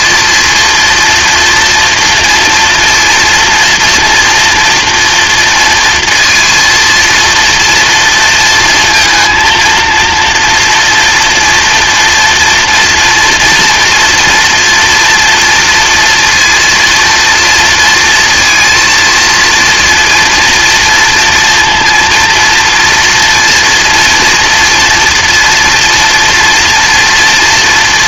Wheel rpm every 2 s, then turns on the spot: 230, 230, 230, 230, 230, 230, 230, 240, 230, 230, 230, 230, 230, 230.
none